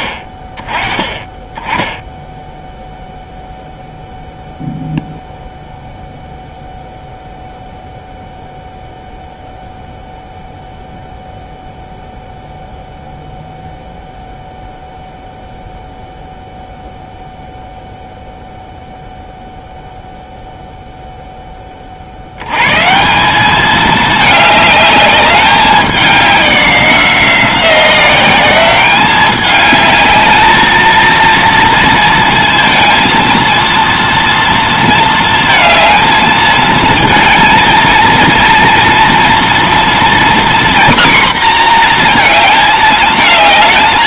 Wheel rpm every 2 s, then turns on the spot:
20, 0, 0, 0, 0, 0, 0, 0, 0, 0, 0, 140, 210, 190, 200, 220, 230, 230, 220, 230, 250, 220.
none